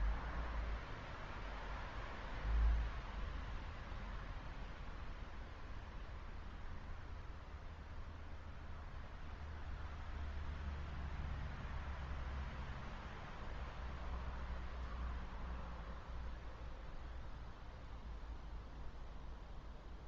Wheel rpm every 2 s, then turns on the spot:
0, 0, 0, 0, 0, 0, 0, 0, 0, 0.
none